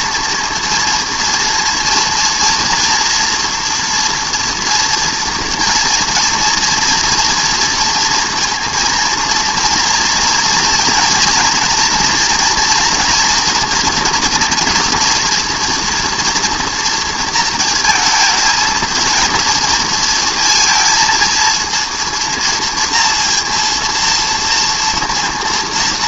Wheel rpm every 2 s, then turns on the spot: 230, 230, 230, 230, 230, 230, 230, 240, 230, 230, 230, 230, 230.
none